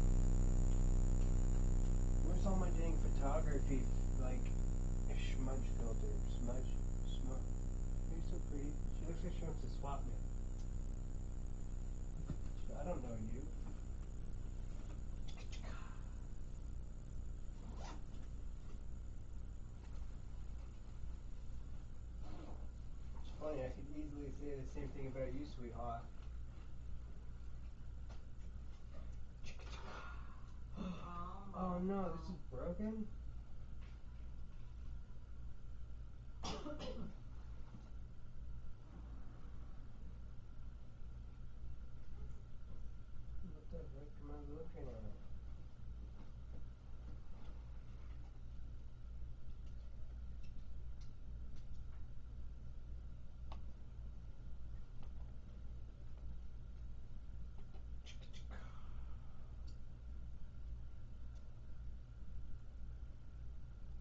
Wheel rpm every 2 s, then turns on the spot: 0, 0, 0, 0, 0, 0, 0, 0, 0, 0, 0, 0, 0, 0, 0, 0, 0, 0, 0, 0, 0, 0, 0, 0, 0, 0, 0, 0, 0, 0, 0, 0.
none